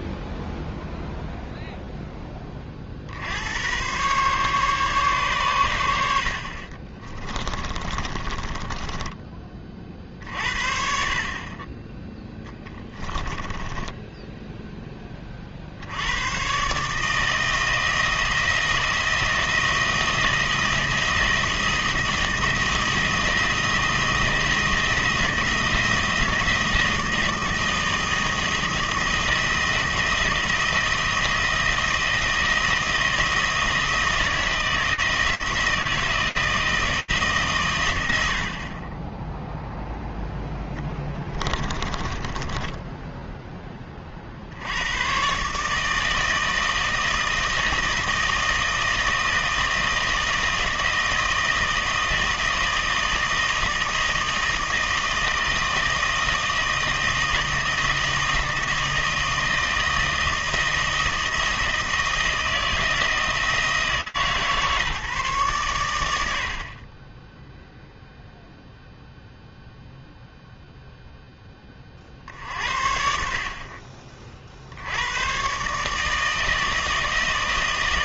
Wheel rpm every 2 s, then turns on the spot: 0, 70, 140, 30, 10, 50, 20, 10, 140, 160, 170, 160, 170, 160, 160, 170, 160, 160, 160, 40, 10, 20, 110, 160, 160, 160, 160, 160, 160, 160, 160, 160, 140, 20, 0, 0, 60, 80, 160.
6-10 12-14 40-42